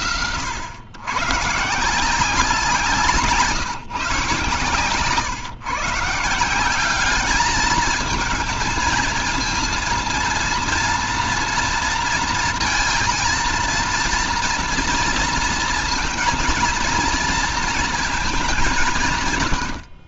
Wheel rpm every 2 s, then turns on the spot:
120, 180, 150, 190, 230, 230, 230, 230, 230, 180.
none